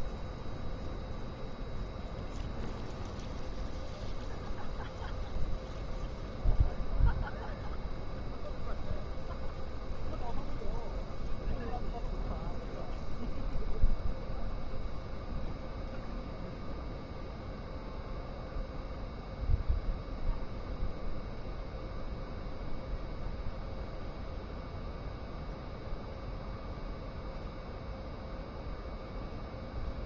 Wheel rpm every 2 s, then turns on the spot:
0, 0, 0, 0, 0, 0, 0, 0, 0, 0, 0, 0, 0, 0, 0.
none